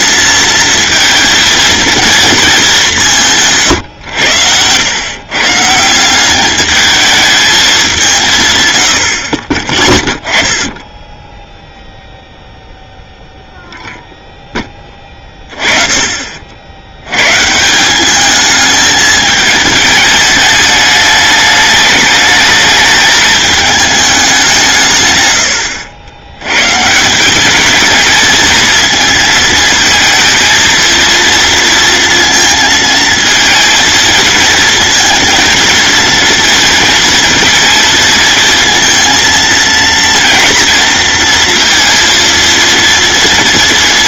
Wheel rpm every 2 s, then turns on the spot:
230, 160, 130, 220, 40, 10, 0, 20, 100, 220, 210, 220, 130, 160, 230, 230, 220, 230, 230, 230, 230, 230.
none